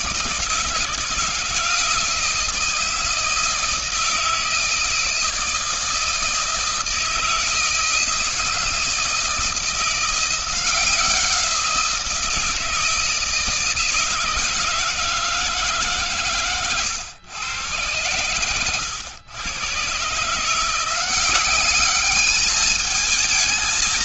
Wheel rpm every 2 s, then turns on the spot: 170, 160, 160, 160, 160, 170, 170, 160, 120, 100, 150, 210.
none